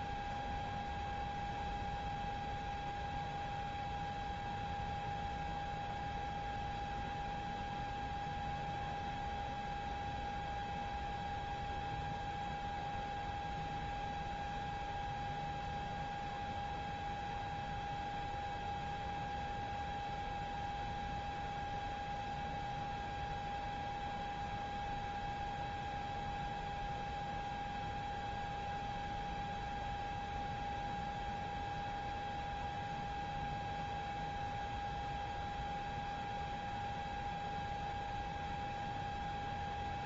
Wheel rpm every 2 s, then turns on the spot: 0, 0, 0, 0, 0, 0, 0, 0, 0, 0, 0, 0, 0, 0, 0, 0, 0, 0, 0, 0.
none